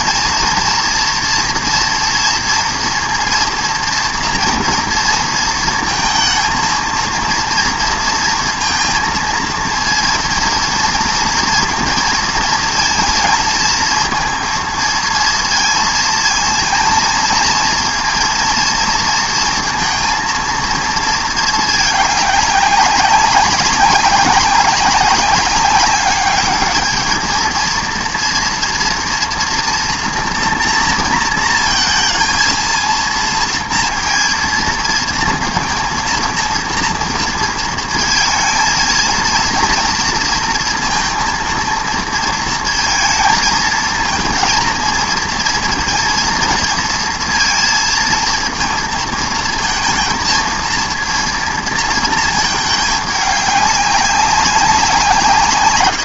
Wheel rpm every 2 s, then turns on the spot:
240, 230, 230, 230, 230, 230, 230, 230, 230, 230, 230, 200, 190, 210, 230, 240, 230, 230, 230, 230, 230, 230, 220, 230, 230, 230, 210, 190.
none